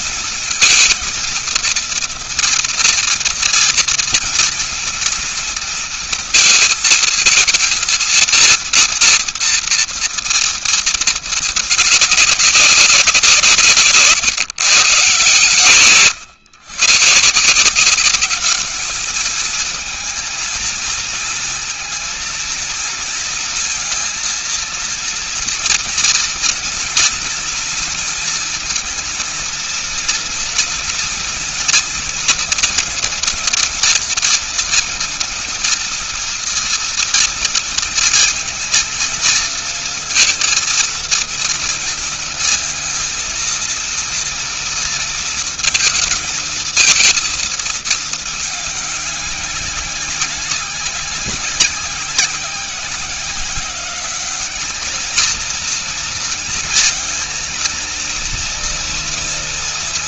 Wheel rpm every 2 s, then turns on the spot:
230, 230, 230, 220, 230, 220, 180, 130, 120, 220, 220, 230, 230, 230, 230, 240, 230, 230, 230, 230, 230, 230, 230, 230, 200, 190, 180, 220, 230, 230.
none